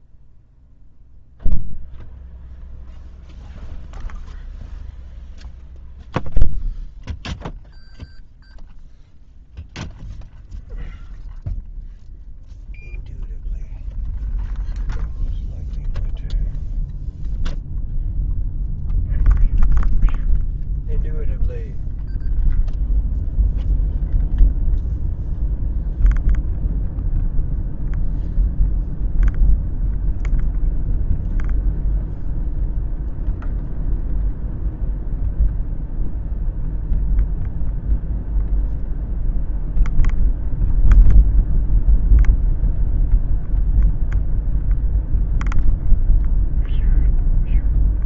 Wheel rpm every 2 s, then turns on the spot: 0, 0, 0, 0, 0, 0, 0, 0, 0, 0, 0, 0, 0, 0, 0, 0, 0, 0, 0, 0, 0, 0, 0, 0.
none